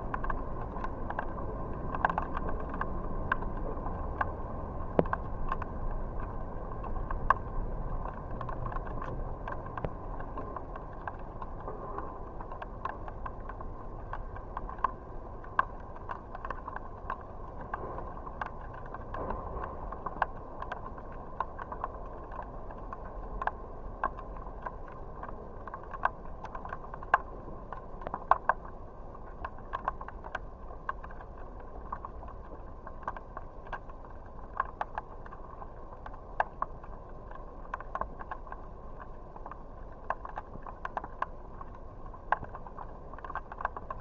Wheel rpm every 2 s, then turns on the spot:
0, 0, 0, 0, 0, 0, 0, 0, 0, 0, 0, 0, 0, 0, 0, 0, 0, 0, 0, 0, 0, 0.
none